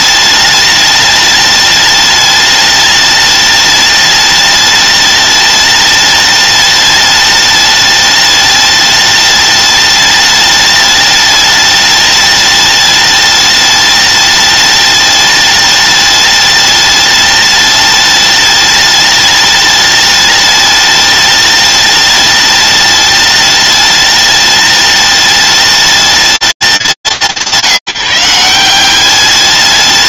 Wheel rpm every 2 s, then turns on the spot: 210, 210, 210, 210, 210, 210, 210, 210, 210, 210, 210, 210, 210, 200, 170.
none